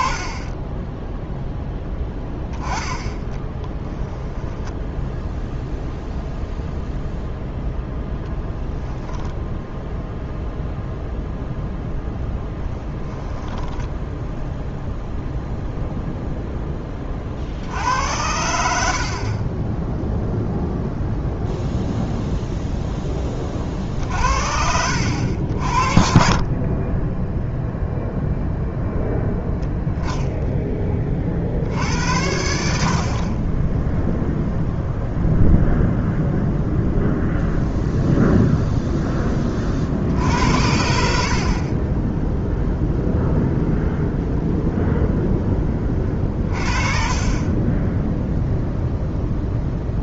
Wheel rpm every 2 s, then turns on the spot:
10, 10, 0, 0, 0, 0, 10, 0, 10, 70, 0, 0, 70, 30, 0, 10, 60, 0, 0, 0, 60, 0, 0, 40, 0.
12-14 18-20